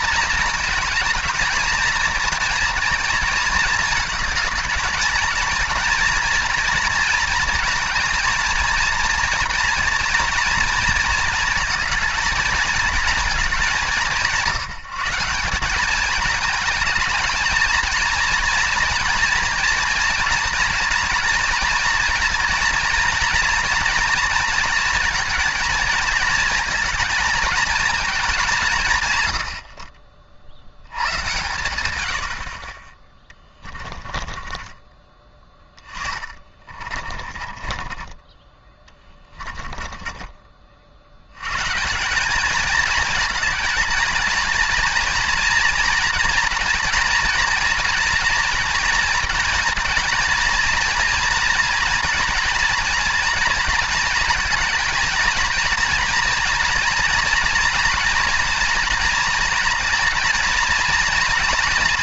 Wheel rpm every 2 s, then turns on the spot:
220, 230, 230, 230, 230, 230, 230, 160, 220, 230, 230, 230, 230, 230, 140, 90, 50, 20, 30, 20, 50, 220, 230, 230, 230, 230, 230, 240, 240, 240, 230.
34-40